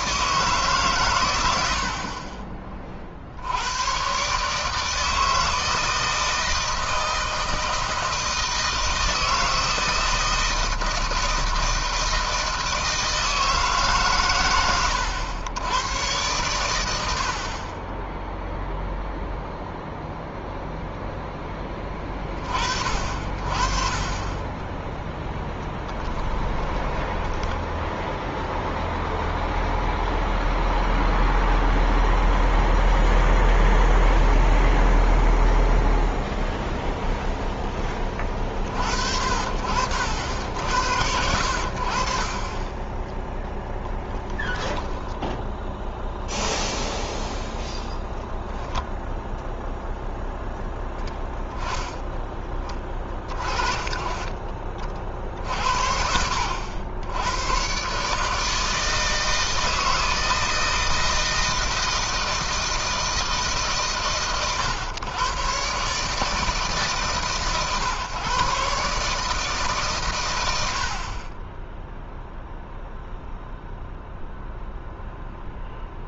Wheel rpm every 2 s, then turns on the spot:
130, 30, 140, 160, 160, 160, 160, 110, 110, 0, 0, 30, 30, 10, 0, 0, 0, 0, 0, 40, 90, 20, 10, 10, 0, 0, 10, 30, 70, 150, 160, 160, 130, 150, 140, 90, 0, 0.
24-28